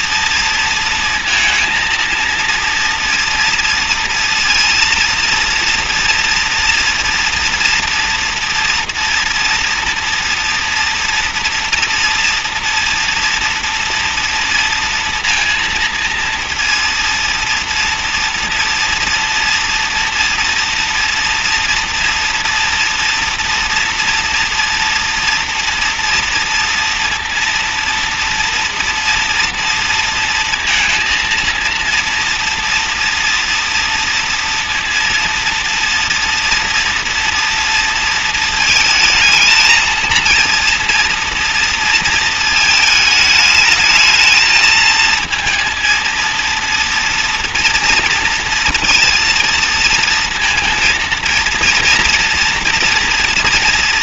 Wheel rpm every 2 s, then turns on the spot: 230, 230, 230, 230, 230, 240, 230, 230, 230, 230, 230, 230, 230, 230, 230, 230, 230, 230, 230, 220, 230, 220, 230, 230, 230, 230, 230.
none